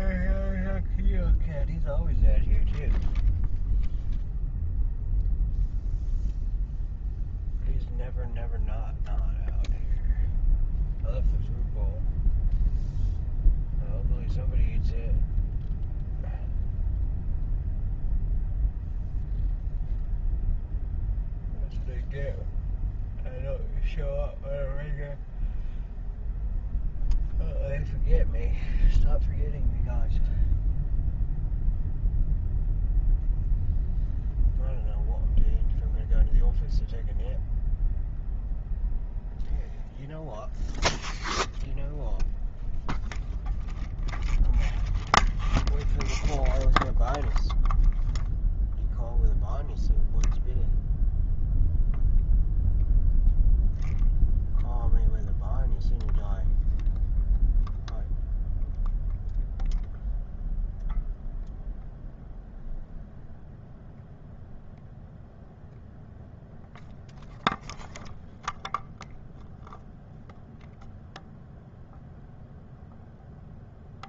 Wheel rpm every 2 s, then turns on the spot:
0, 0, 0, 0, 0, 0, 0, 0, 0, 0, 0, 0, 0, 0, 0, 0, 0, 0, 0, 0, 0, 0, 0, 0, 0, 0, 0, 0, 0, 0, 0, 0, 0, 0, 0, 0, 0.
none